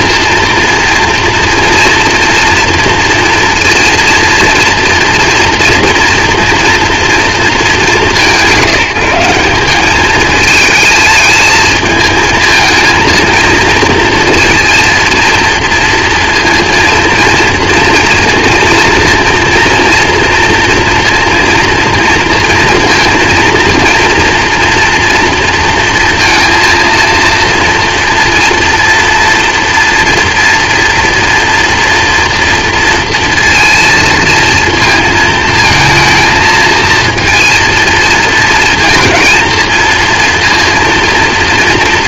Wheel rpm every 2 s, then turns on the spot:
230, 230, 230, 230, 170, 220, 220, 230, 230, 230, 240, 230, 230, 230, 230, 230, 230, 230, 220, 230, 230.
none